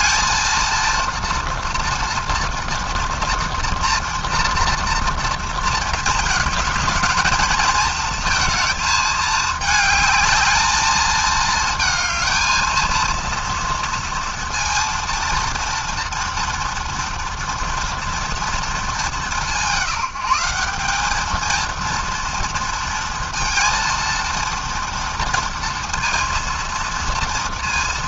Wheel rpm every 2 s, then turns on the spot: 230, 230, 230, 220, 220, 220, 230, 230, 230, 200, 210, 230, 230, 230.
none